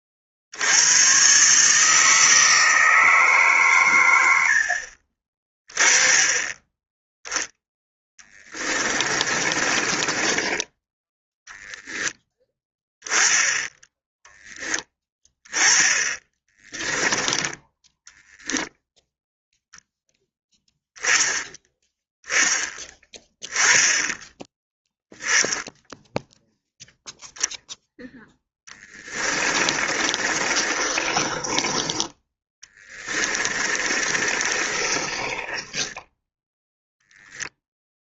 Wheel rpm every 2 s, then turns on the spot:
100, 160, 50, 10, 20, 10, 10, 10, 20, 0, 10, 10, 10, 0, 10, 30, 20, 30, 0.
8-12 28-36